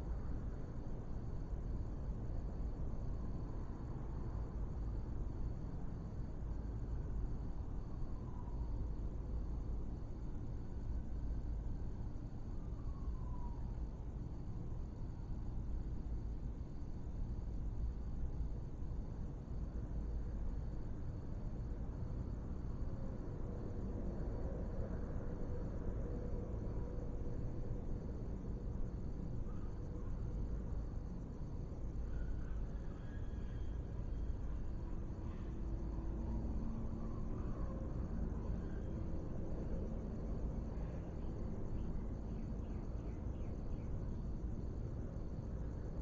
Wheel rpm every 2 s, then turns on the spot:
0, 0, 0, 0, 0, 0, 0, 0, 0, 0, 0, 0, 0, 0, 0, 0, 0, 0, 0, 0, 0, 0, 0.
none